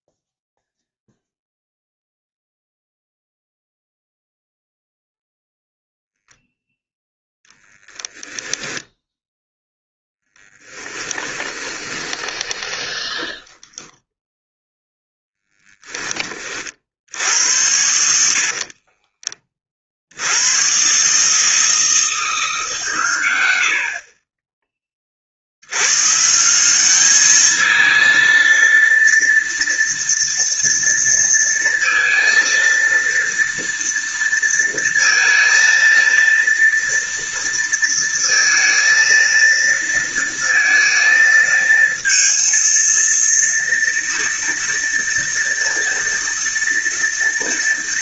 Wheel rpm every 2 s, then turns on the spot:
0, 0, 0, 0, 0, 10, 20, 0, 60, 40, 120, 130, 20, 200, 230, 230, 230, 230, 230, 230, 230, 230, 230, 230.
10-14 18-20